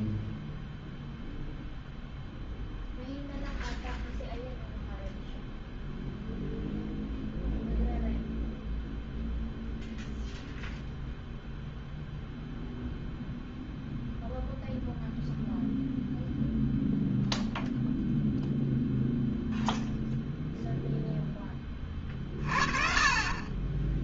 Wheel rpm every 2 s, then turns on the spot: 0, 0, 0, 0, 0, 0, 0, 0, 0, 0, 0, 40.
none